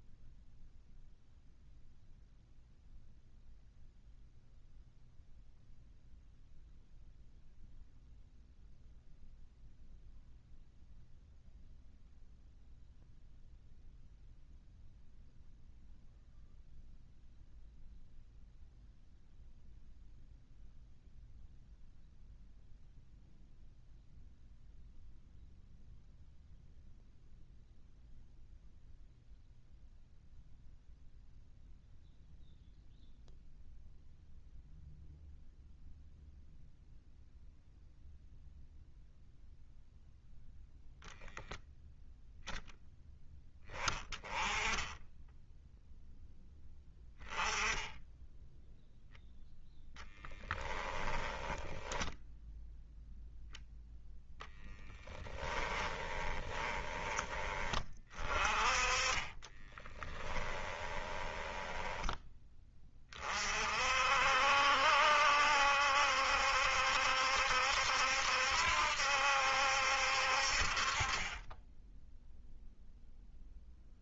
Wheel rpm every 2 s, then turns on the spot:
0, 0, 0, 0, 0, 0, 0, 0, 0, 0, 0, 0, 0, 0, 0, 0, 0, 0, 0, 0, 0, 10, 10, 10, 0, 10, 0, 10, 20, 30, 20, 30, 70, 70, 70, 40, 0.
50-52 54-56 58-62